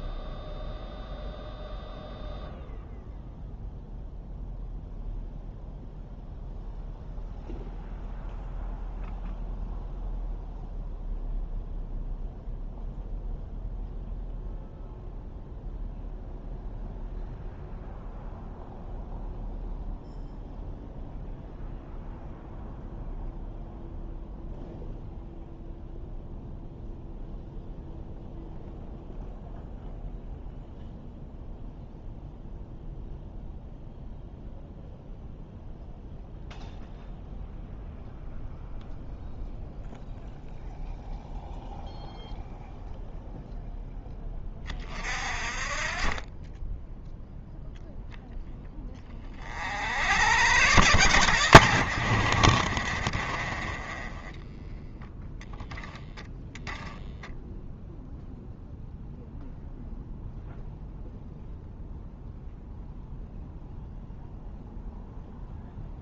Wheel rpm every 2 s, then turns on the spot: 0, 0, 0, 0, 0, 0, 0, 0, 0, 0, 0, 0, 0, 0, 0, 0, 0, 0, 0, 0, 0, 0, 30, 10, 20, 100, 50, 10, 0, 0, 0, 0, 0.
52-54